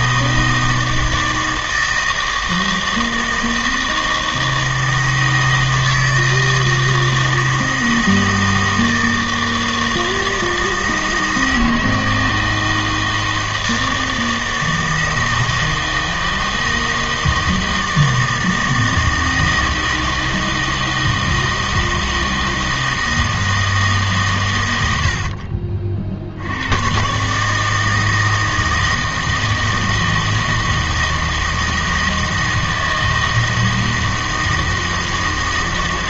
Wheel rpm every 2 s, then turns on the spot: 160, 160, 160, 160, 160, 160, 160, 160, 160, 160, 160, 160, 80, 110, 160, 160, 160, 160.
none